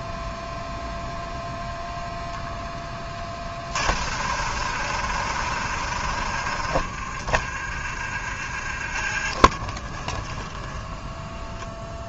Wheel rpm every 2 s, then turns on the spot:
0, 10, 60, 40, 40, 20.
10-12